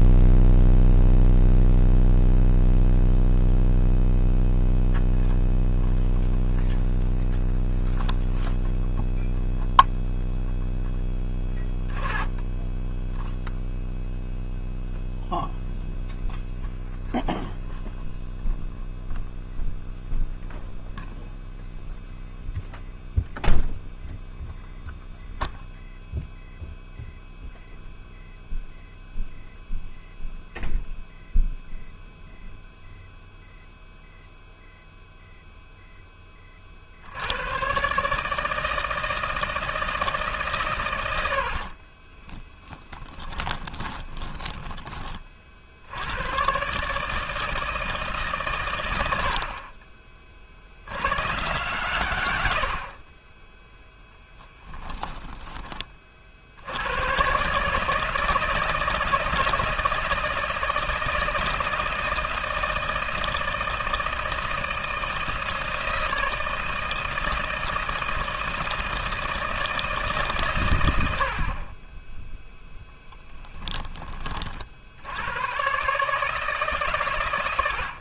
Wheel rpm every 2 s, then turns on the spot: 0, 0, 0, 0, 0, 0, 10, 0, 0, 0, 0, 0, 0, 0, 0, 0, 0, 0, 40, 160, 120, 20, 10, 130, 120, 70, 80, 10, 80, 160, 160, 160, 160, 160, 160, 150, 0, 50, 150.
42-44 54-56